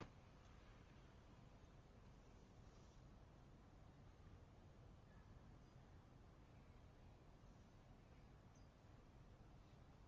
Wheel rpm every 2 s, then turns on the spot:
0, 0, 0, 0, 0.
none